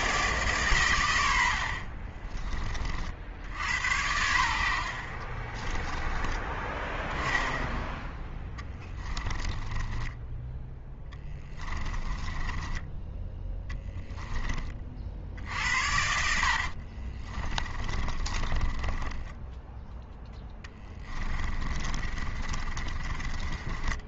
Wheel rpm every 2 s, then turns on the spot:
130, 40, 70, 10, 10, 10, 10, 30, 60, 20, 10, 30.
8-14 16-24